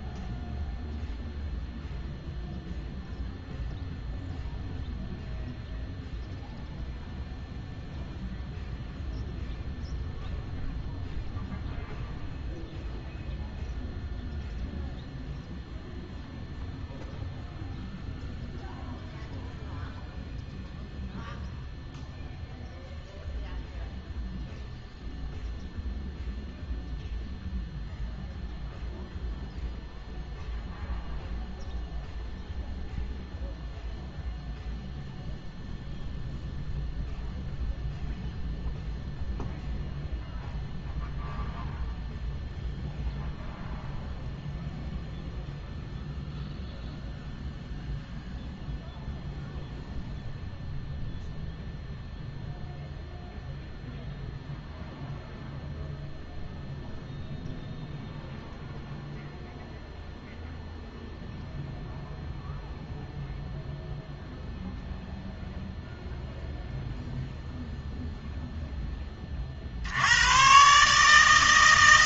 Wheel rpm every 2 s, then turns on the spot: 0, 0, 0, 0, 0, 0, 0, 0, 0, 0, 0, 0, 0, 0, 0, 0, 0, 0, 0, 0, 0, 0, 0, 0, 0, 0, 0, 0, 0, 0, 0, 0, 0, 0, 0, 130.
none